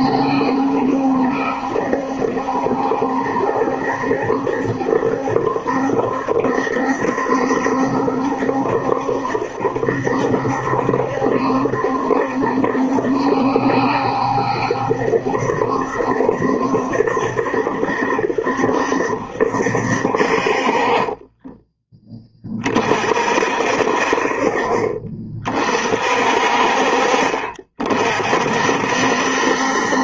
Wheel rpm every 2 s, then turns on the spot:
70, 70, 70, 70, 70, 70, 70, 70, 70, 70, 30, 40, 40, 50, 60.
20-22